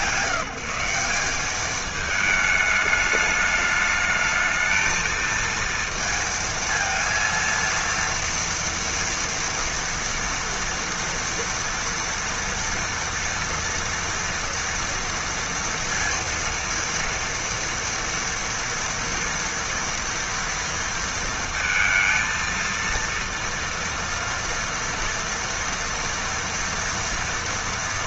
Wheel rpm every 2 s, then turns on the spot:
170, 210, 220, 230, 230, 230, 230, 240, 230, 230, 230, 230, 230, 240.
none